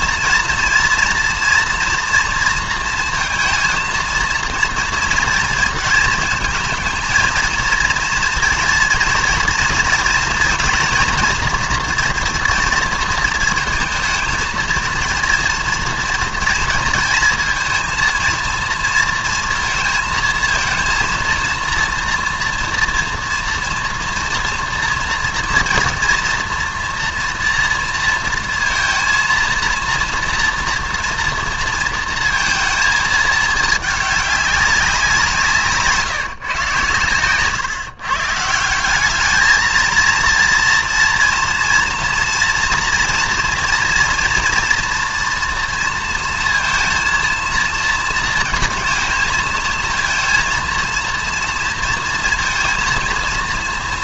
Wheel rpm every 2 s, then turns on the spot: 230, 230, 230, 230, 230, 230, 230, 230, 230, 230, 230, 230, 230, 230, 230, 230, 220, 190, 130, 170, 230, 230, 230, 230, 220, 230, 230.
none